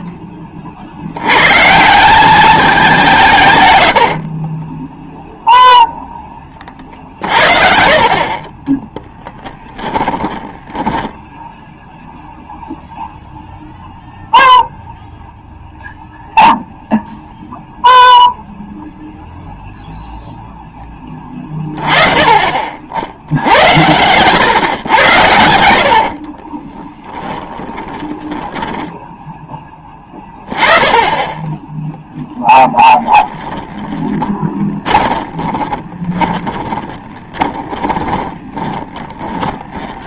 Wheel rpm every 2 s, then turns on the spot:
40, 190, 10, 40, 30, 10, 0, 0, 0, 0, 10, 60, 110, 20, 20, 20, 10, 10, 20, 20.
4-12 26-30 32-40